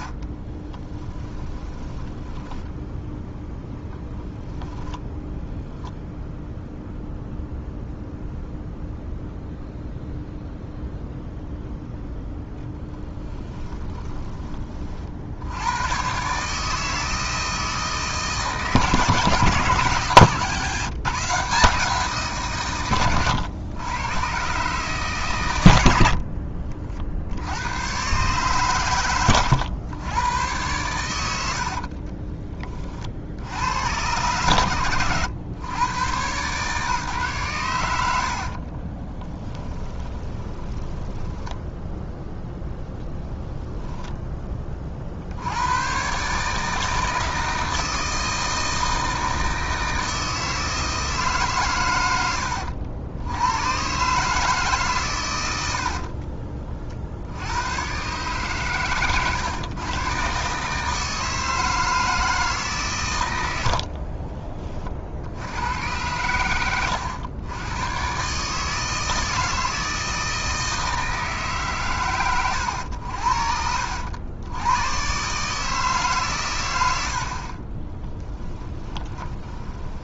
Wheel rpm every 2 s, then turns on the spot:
10, 20, 0, 0, 0, 0, 10, 50, 160, 150, 160, 120, 140, 50, 110, 110, 30, 120, 140, 30, 20, 0, 30, 160, 160, 160, 90, 130, 60, 130, 150, 130, 40, 100, 160, 160, 80, 120, 80, 10.
0-4 38-42 78-80